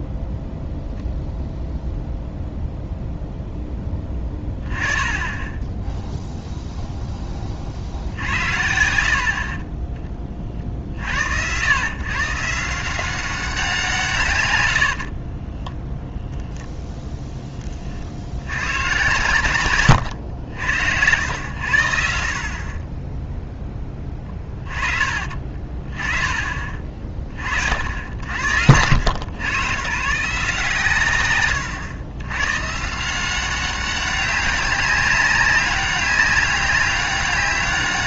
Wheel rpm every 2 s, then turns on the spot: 0, 0, 20, 0, 70, 50, 170, 90, 10, 100, 80, 40, 20, 40, 90, 140, 140, 200, 200.
14-16